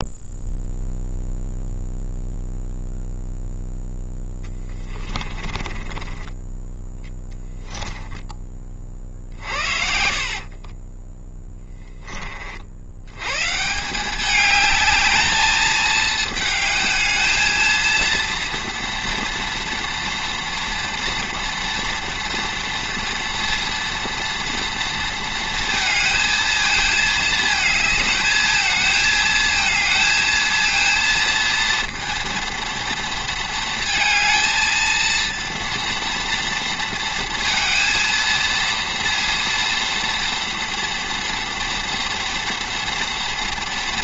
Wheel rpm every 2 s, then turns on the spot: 0, 0, 20, 10, 30, 40, 60, 210, 220, 240, 230, 230, 230, 220, 220, 230, 230, 220, 230, 230, 230, 230.
4-8 10-12